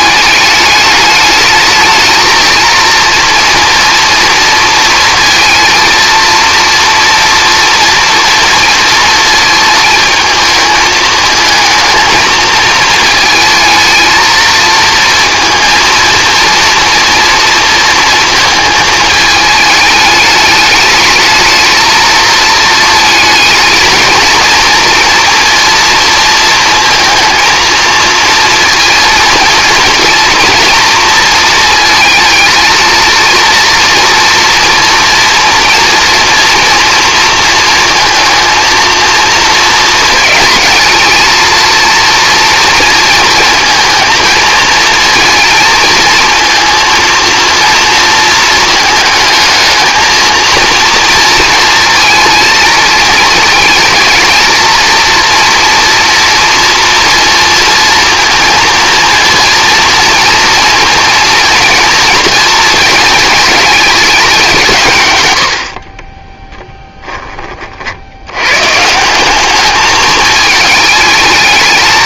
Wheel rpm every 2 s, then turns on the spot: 210, 230, 230, 230, 230, 220, 220, 230, 230, 220, 210, 220, 230, 230, 230, 230, 230, 230, 230, 230, 220, 230, 220, 230, 220, 230, 220, 230, 230, 230, 230, 230, 150, 10, 140, 220.
none